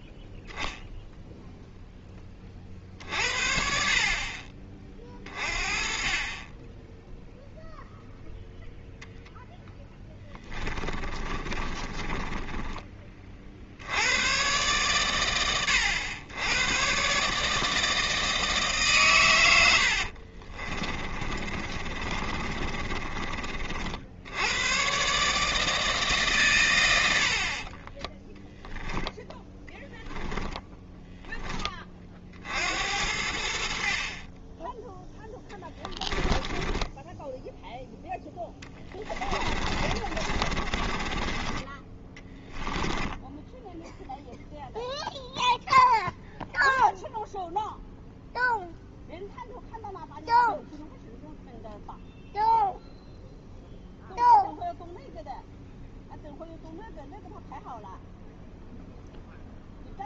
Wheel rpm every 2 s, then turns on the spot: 0, 40, 30, 20, 0, 10, 20, 120, 120, 150, 30, 30, 120, 110, 0, 10, 70, 10, 10, 10, 30, 20, 0, 0, 0, 0, 0, 0, 0, 0.
10-12 20-24 30-32 36-44